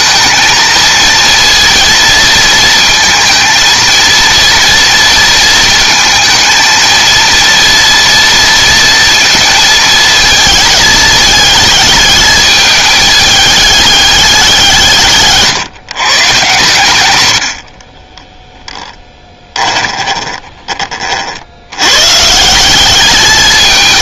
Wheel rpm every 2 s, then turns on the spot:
230, 230, 230, 230, 230, 220, 210, 170, 120, 0, 30, 180.
none